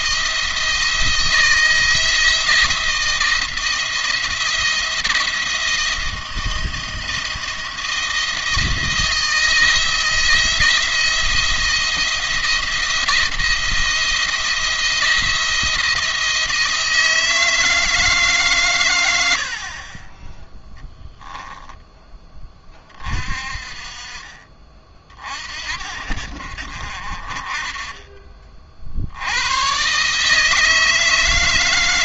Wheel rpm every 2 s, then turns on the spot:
160, 170, 170, 170, 160, 170, 170, 160, 160, 130, 10, 20, 40, 50, 60, 160.
20-22